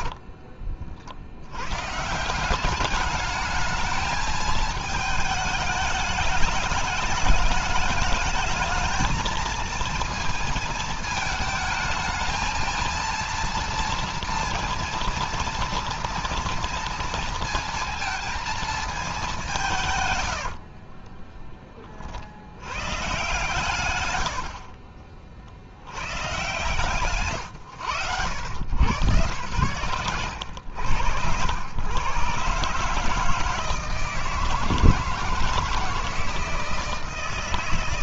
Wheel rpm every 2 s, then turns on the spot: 60, 170, 220, 210, 220, 230, 220, 230, 230, 220, 80, 80, 80, 130, 100, 100, 130, 160, 160.
0-2 20-22 24-26